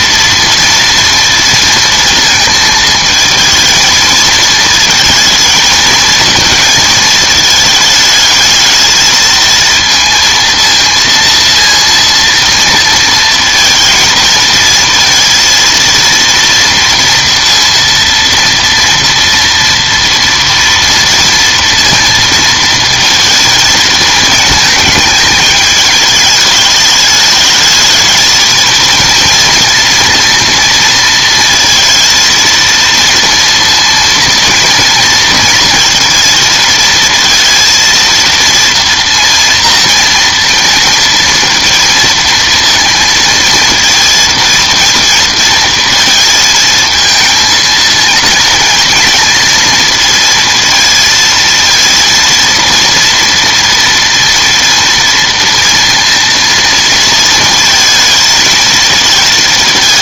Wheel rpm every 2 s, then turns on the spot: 230, 220, 220, 230, 220, 230, 230, 220, 230, 230, 230, 230, 220, 210, 230, 230, 230, 230, 230, 230, 230, 230, 230, 230, 230, 230, 230, 230, 230, 220.
none